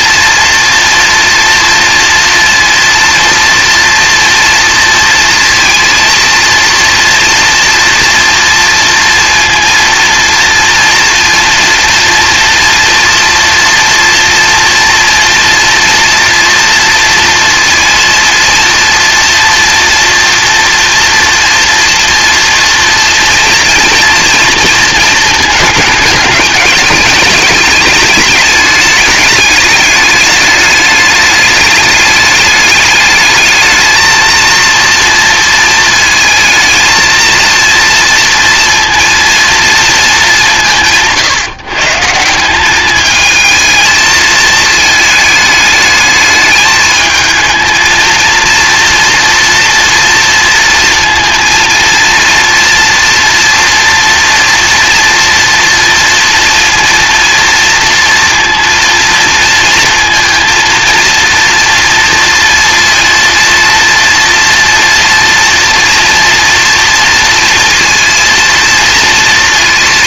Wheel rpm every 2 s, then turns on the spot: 230, 230, 230, 230, 230, 230, 230, 230, 230, 230, 230, 230, 230, 210, 210, 210, 210, 230, 230, 230, 170, 190, 220, 210, 230, 230, 230, 240, 230, 230, 230, 230, 230, 230, 230.
none